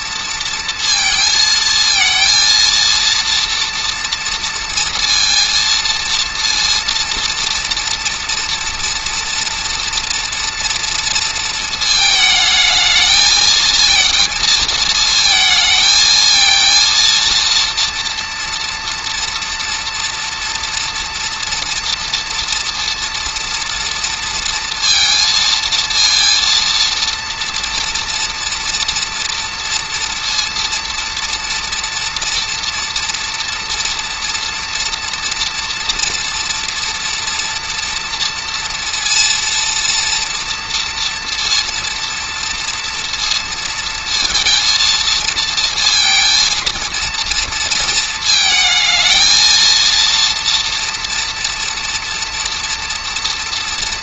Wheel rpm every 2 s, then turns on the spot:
230, 230, 230, 230, 230, 230, 220, 220, 230, 230, 230, 230, 230, 230, 230, 230, 230, 240, 240, 230, 230, 230, 230, 230, 220, 230, 230.
none